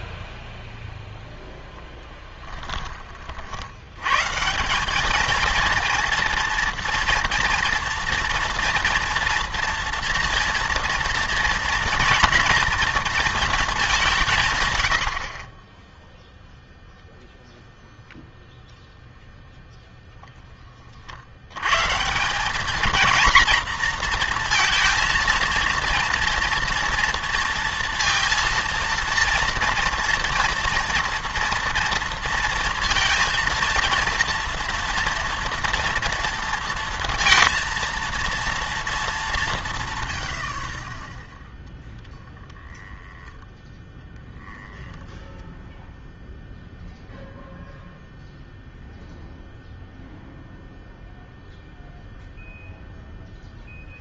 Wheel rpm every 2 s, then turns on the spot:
0, 10, 160, 230, 230, 230, 240, 120, 0, 0, 30, 210, 230, 230, 230, 230, 230, 230, 230, 220, 60, 10, 10, 0, 0, 0, 0.
42-46